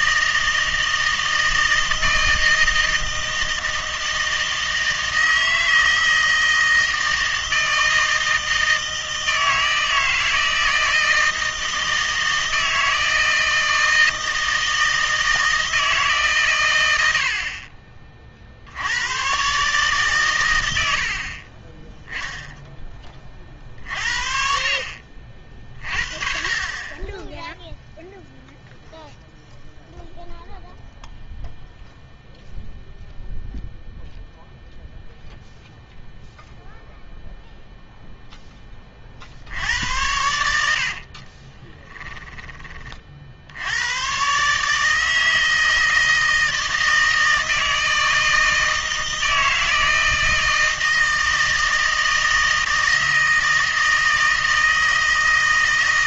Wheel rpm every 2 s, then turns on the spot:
160, 160, 160, 160, 160, 160, 160, 160, 110, 70, 80, 10, 50, 40, 0, 0, 0, 0, 0, 20, 70, 20, 150, 160, 160, 160, 160, 160.
40-42